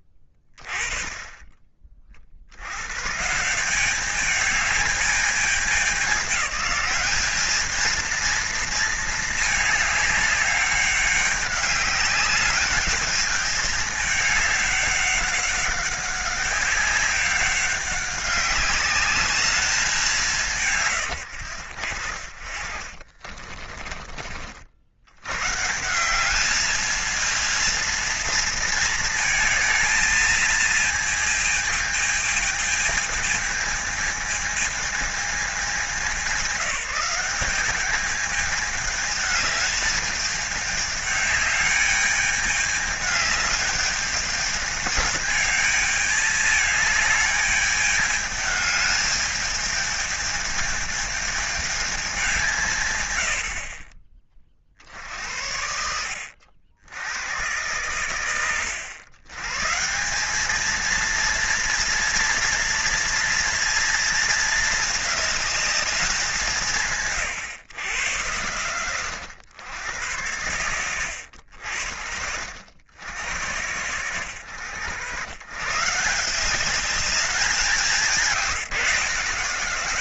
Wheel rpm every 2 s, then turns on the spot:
20, 80, 210, 200, 220, 200, 210, 200, 190, 200, 140, 50, 60, 220, 230, 220, 220, 220, 180, 210, 210, 210, 220, 210, 210, 220, 140, 50, 90, 90, 210, 230, 220, 190, 110, 100, 60, 100, 190, 170.
none